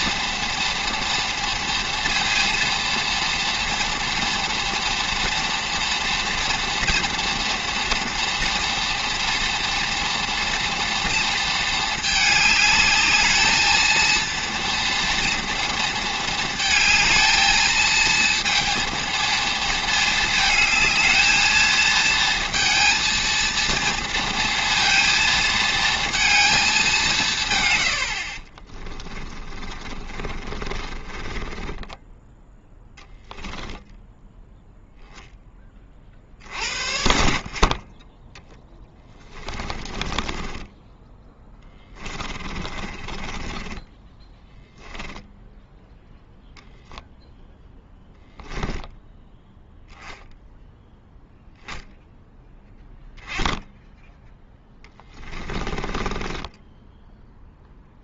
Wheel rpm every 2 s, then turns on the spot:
230, 230, 230, 230, 230, 230, 220, 230, 220, 230, 220, 230, 230, 190, 20, 30, 0, 0, 60, 10, 20, 30, 10, 0, 10, 0, 10, 10, 10.
28-32 38-46 54-58